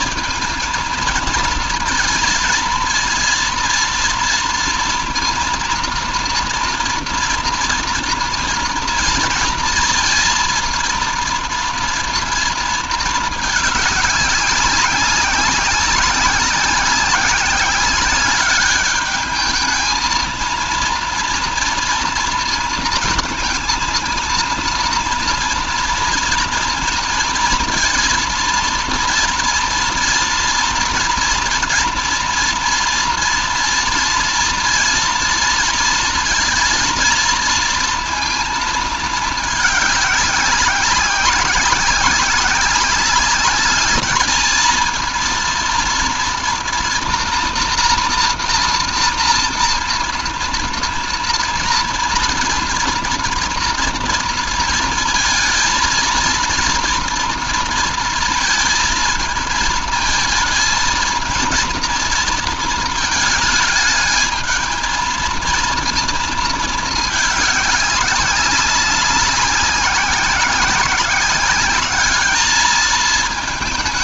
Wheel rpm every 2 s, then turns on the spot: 230, 230, 230, 230, 230, 230, 220, 200, 190, 210, 230, 230, 230, 230, 230, 230, 240, 230, 230, 220, 200, 200, 230, 240, 230, 230, 230, 230, 230, 220, 230, 220, 220, 210, 190, 190, 220.
none